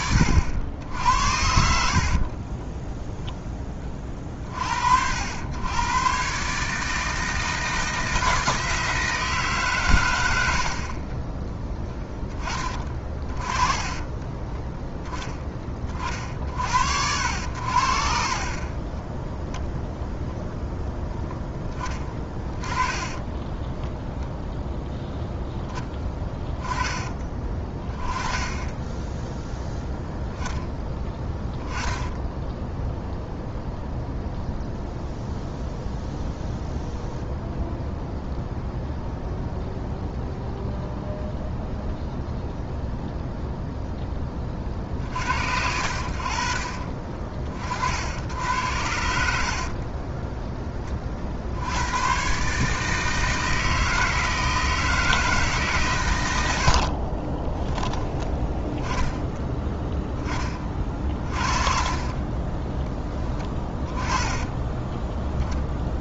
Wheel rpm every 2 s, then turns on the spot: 70, 20, 50, 140, 160, 70, 30, 20, 60, 30, 0, 20, 0, 10, 10, 10, 0, 0, 0, 0, 0, 0, 30, 40, 80, 10, 140, 160, 80, 10, 30, 20, 10.
2-4 22-24 56-58 62-66